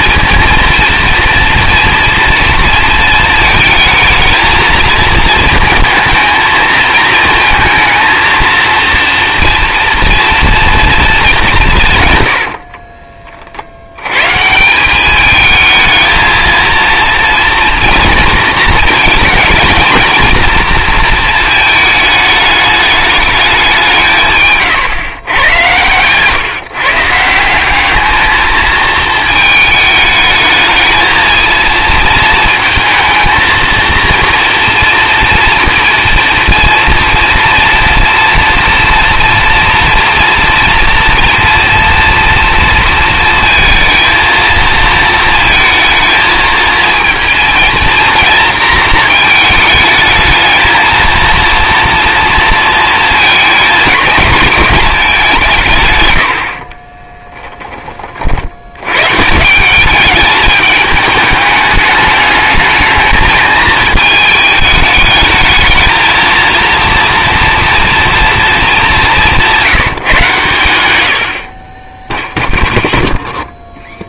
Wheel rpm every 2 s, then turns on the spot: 230, 230, 220, 220, 230, 230, 60, 160, 220, 230, 220, 210, 140, 130, 220, 220, 230, 230, 230, 240, 230, 230, 220, 220, 230, 220, 230, 210, 50, 90, 210, 220, 220, 230, 220, 120, 0.
12-14 56-58